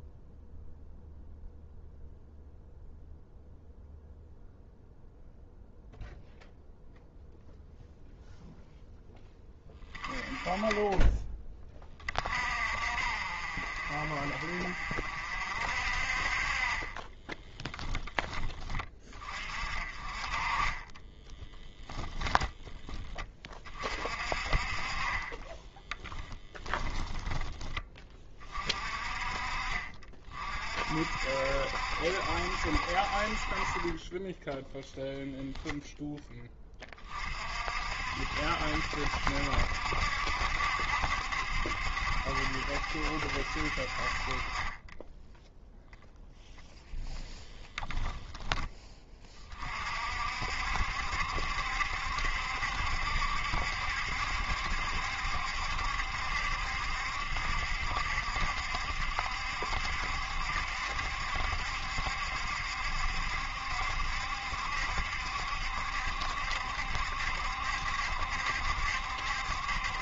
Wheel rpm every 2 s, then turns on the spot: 0, 0, 0, 0, 0, 20, 50, 50, 30, 20, 20, 10, 40, 10, 40, 50, 60, 10, 20, 70, 70, 70, 20, 0, 10, 60, 70, 70, 70, 70, 70, 70, 70, 70, 70.
16-18 26-28